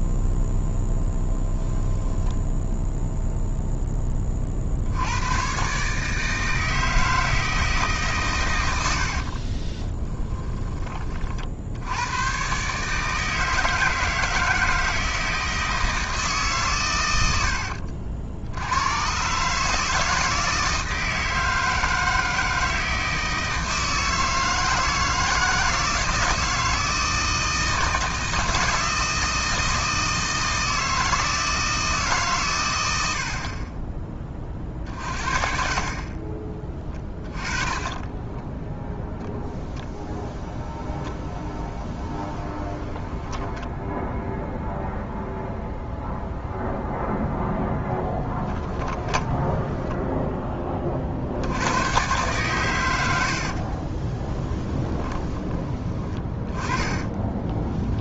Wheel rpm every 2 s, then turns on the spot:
0, 0, 70, 160, 90, 30, 150, 160, 110, 100, 160, 160, 160, 160, 160, 160, 100, 40, 20, 0, 10, 10, 0, 0, 10, 40, 100, 20, 20.
8-10 36-38 42-44 48-50 54-58